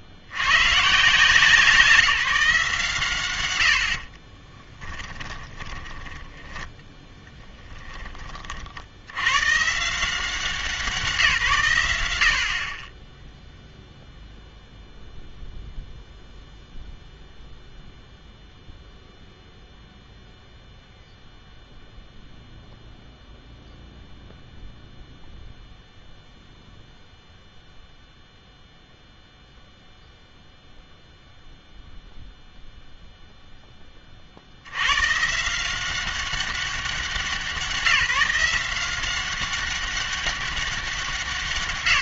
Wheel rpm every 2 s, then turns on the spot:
120, 150, 10, 10, 40, 180, 40, 0, 0, 0, 0, 0, 0, 0, 0, 0, 0, 80, 190, 180, 200.
4-6